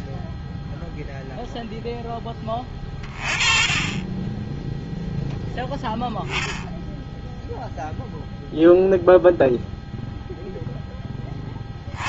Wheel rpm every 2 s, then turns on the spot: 0, 10, 10, 10, 0, 0.
none